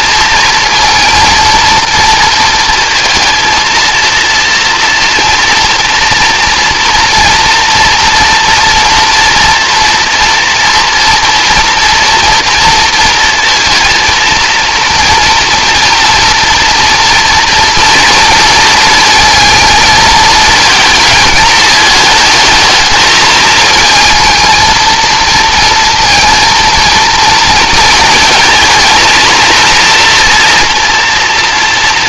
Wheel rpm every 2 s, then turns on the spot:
230, 230, 230, 230, 230, 240, 230, 240, 230, 230, 220, 220, 220, 230, 230, 230.
none